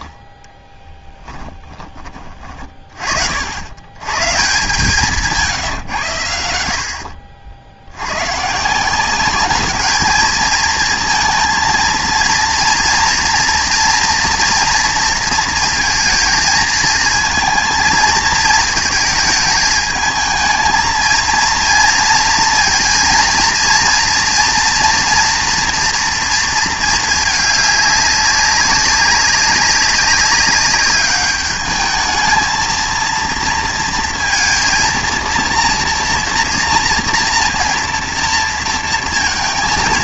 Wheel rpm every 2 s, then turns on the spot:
30, 40, 170, 70, 170, 230, 240, 230, 220, 220, 220, 230, 230, 220, 200, 200, 230, 230, 230, 230.
0-2